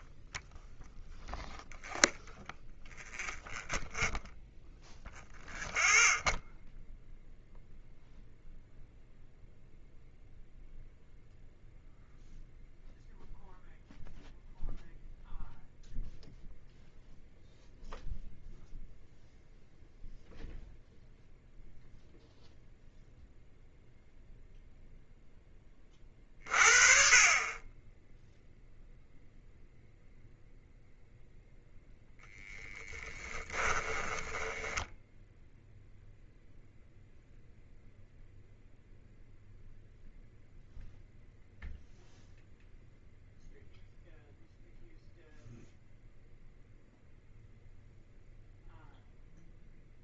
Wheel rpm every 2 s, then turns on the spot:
0, 0, 0, 0, 0, 0, 0, 0, 0, 0, 0, 0, 0, 30, 0, 0, 10, 10, 0, 0, 0, 0, 0, 0, 0.
32-34